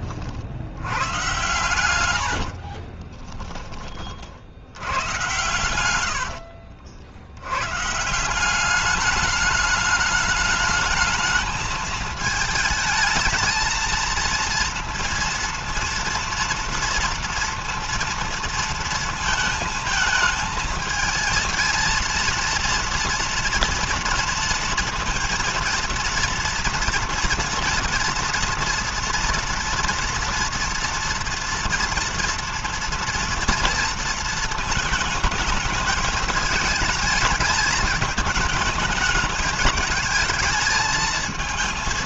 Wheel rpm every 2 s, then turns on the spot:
50, 70, 60, 70, 180, 210, 220, 230, 230, 230, 220, 230, 230, 230, 230, 230, 230, 220, 220, 210, 220.
2-4 6-8